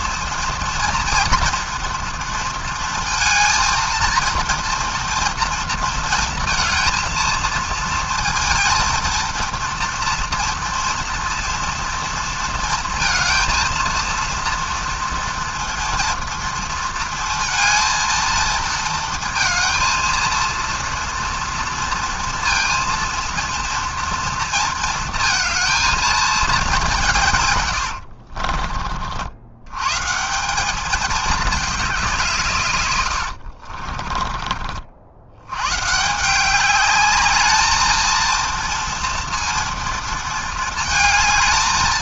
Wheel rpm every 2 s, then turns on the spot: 230, 230, 230, 230, 230, 230, 230, 230, 230, 230, 230, 230, 230, 200, 40, 200, 120, 50, 200, 230, 220.
none